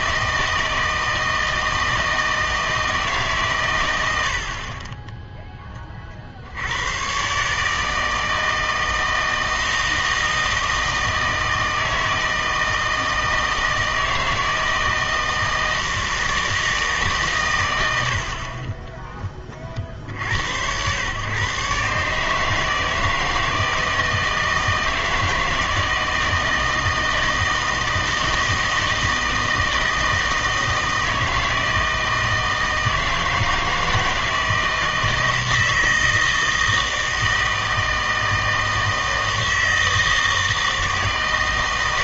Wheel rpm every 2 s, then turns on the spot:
160, 160, 40, 90, 160, 160, 160, 160, 160, 30, 80, 160, 160, 160, 160, 160, 160, 160, 160, 160, 160.
none